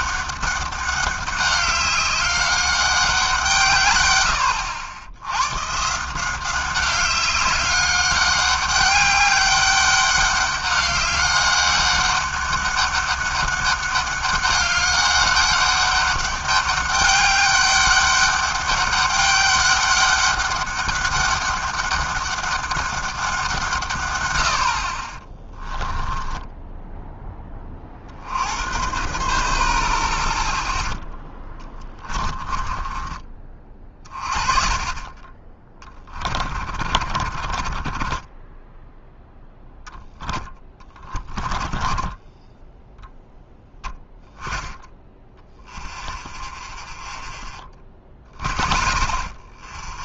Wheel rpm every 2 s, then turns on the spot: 200, 200, 80, 190, 200, 200, 200, 200, 200, 200, 200, 200, 60, 10, 80, 10, 20, 30, 40, 10, 10, 10, 10, 40, 40.
26-28 32-34 36-38 40-42 46-50